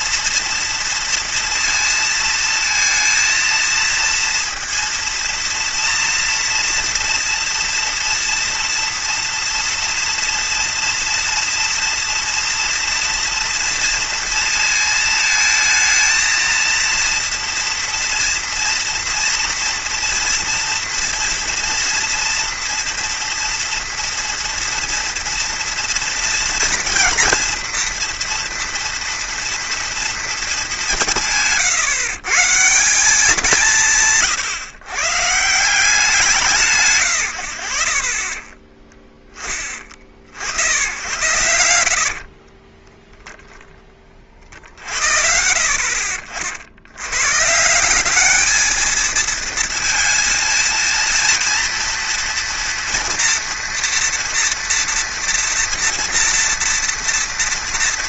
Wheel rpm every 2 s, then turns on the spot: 230, 230, 230, 230, 240, 230, 230, 230, 230, 230, 230, 230, 230, 240, 230, 200, 170, 150, 120, 30, 80, 10, 50, 90, 220, 230, 230, 240, 230.
42-44